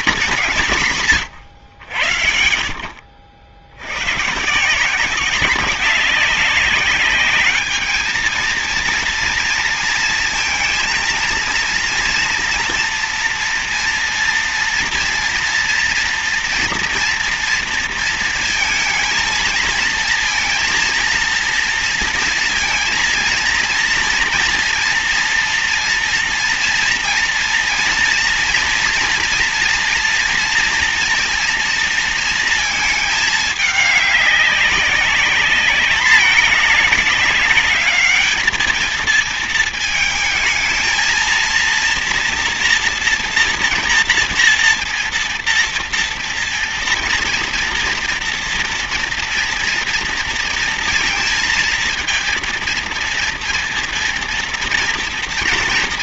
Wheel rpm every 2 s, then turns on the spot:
170, 70, 170, 200, 230, 230, 230, 230, 230, 230, 230, 230, 230, 230, 230, 230, 220, 200, 200, 220, 230, 240, 230, 230, 240, 230, 230, 230.
none